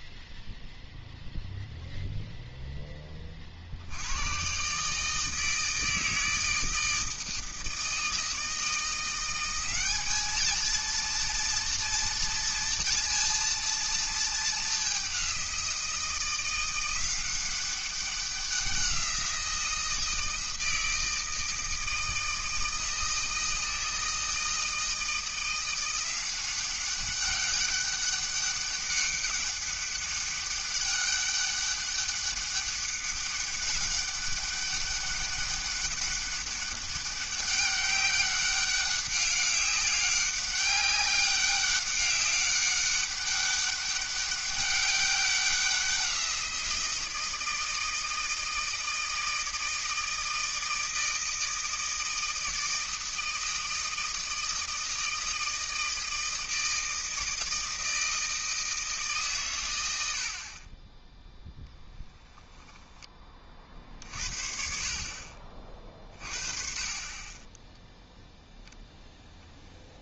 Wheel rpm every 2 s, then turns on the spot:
0, 0, 130, 160, 170, 230, 230, 210, 180, 180, 160, 160, 160, 190, 200, 200, 200, 200, 200, 200, 200, 200, 200, 170, 160, 160, 160, 160, 160, 160, 30, 10, 60, 30, 0.
none